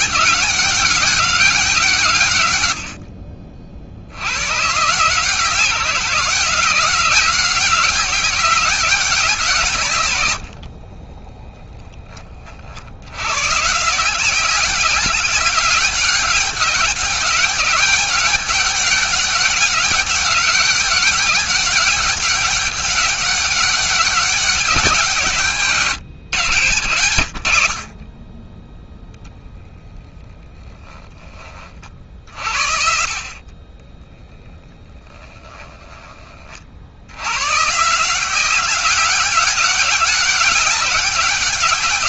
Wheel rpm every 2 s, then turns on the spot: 200, 60, 150, 190, 190, 30, 80, 190, 200, 200, 200, 200, 170, 90, 0, 20, 60, 10, 80, 190, 190.
10-12 34-36